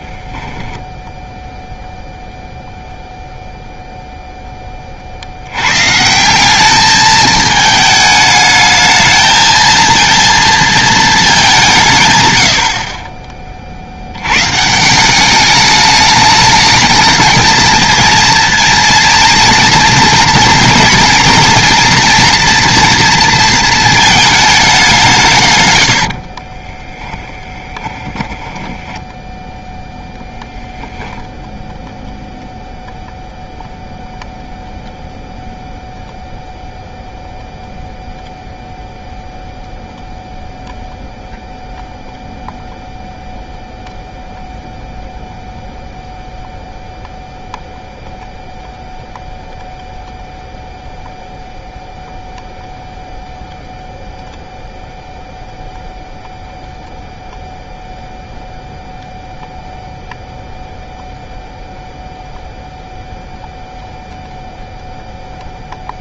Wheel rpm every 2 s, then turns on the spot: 10, 0, 10, 200, 220, 230, 100, 120, 210, 230, 230, 230, 210, 40, 10, 20, 0, 0, 0, 0, 0, 0, 0, 0, 0, 0, 0, 0, 0, 0, 0, 0, 0.
26-32